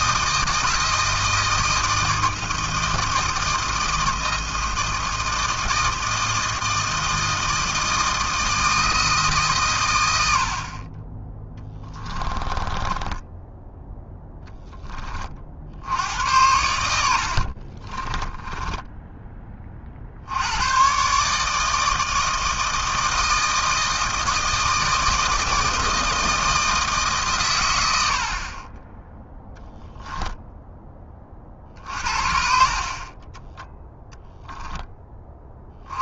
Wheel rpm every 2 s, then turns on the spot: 160, 160, 160, 160, 160, 60, 20, 10, 100, 20, 80, 160, 160, 160, 50, 10, 50, 0.
12-14 16-20